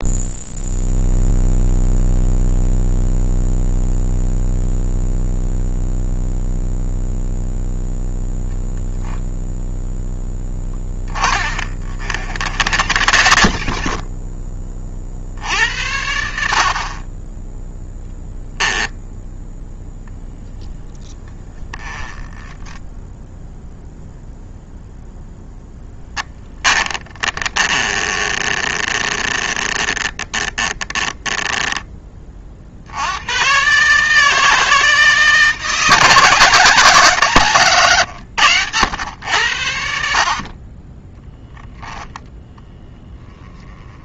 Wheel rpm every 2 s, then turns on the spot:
0, 0, 0, 0, 0, 10, 90, 50, 30, 10, 10, 0, 0, 20, 20, 20, 80, 160, 150, 100, 20, 10.
10-14 26-32